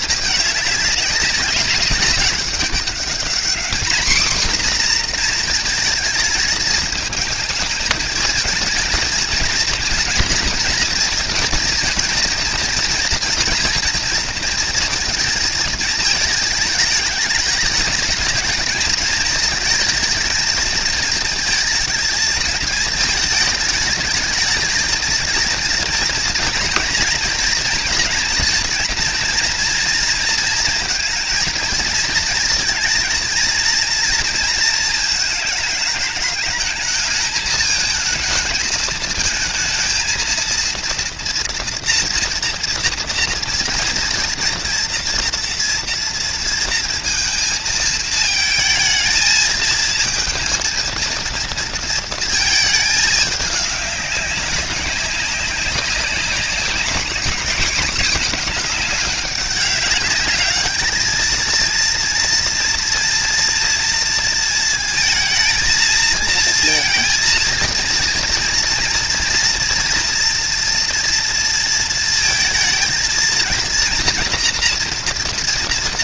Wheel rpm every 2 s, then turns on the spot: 210, 200, 240, 220, 220, 230, 230, 230, 210, 220, 230, 220, 220, 230, 230, 230, 230, 220, 210, 220, 230, 230, 240, 230, 220, 220, 220, 200, 200, 220, 210, 230, 220, 230, 230, 230, 220, 240.
none